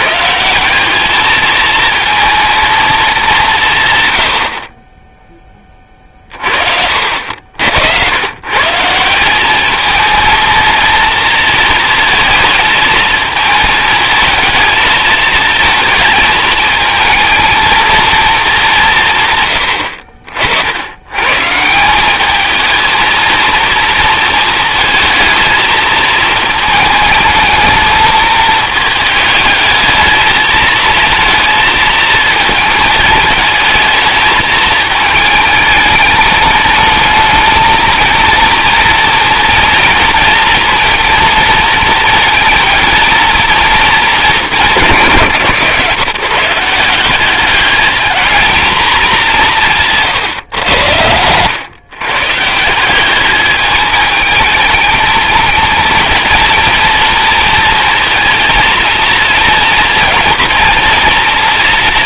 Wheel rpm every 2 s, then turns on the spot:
200, 210, 20, 60, 170, 230, 220, 220, 220, 160, 100, 230, 230, 220, 220, 220, 220, 220, 210, 230, 230, 230, 170, 180, 210, 100, 190, 220, 230, 230, 230.
50-52